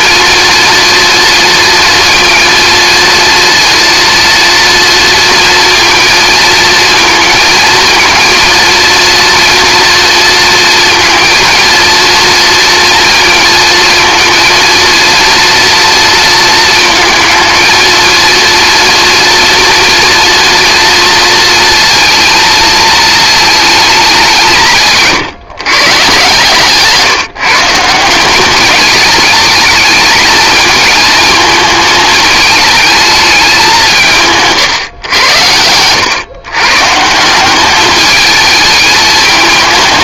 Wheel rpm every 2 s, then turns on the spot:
230, 230, 230, 230, 230, 230, 230, 230, 220, 230, 230, 220, 150, 160, 220, 220, 220, 110, 150, 220.
none